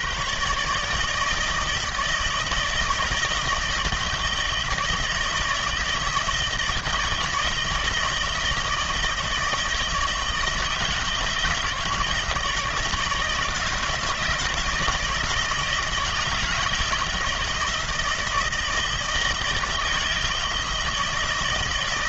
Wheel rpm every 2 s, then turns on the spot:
140, 160, 160, 160, 160, 160, 160, 160, 160, 160, 160.
none